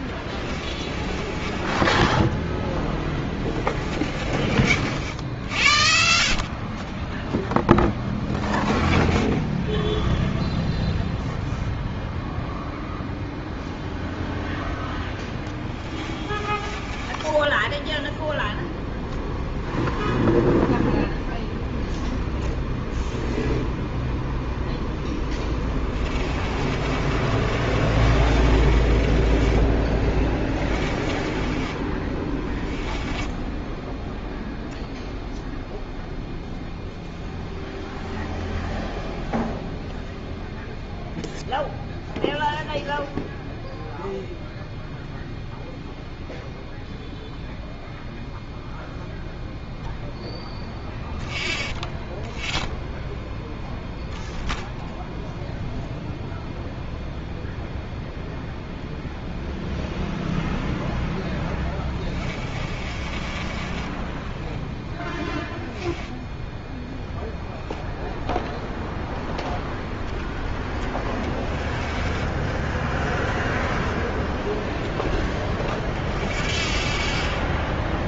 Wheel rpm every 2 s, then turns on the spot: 30, 10, 40, 40, 0, 0, 0, 0, 20, 0, 0, 0, 0, 30, 40, 20, 20, 0, 0, 0, 0, 0, 0, 0, 0, 0, 0, 0, 0, 0, 0, 30, 10, 10, 0, 10, 10, 0, 50.
0-2 16-18 26-34 62-64 70-72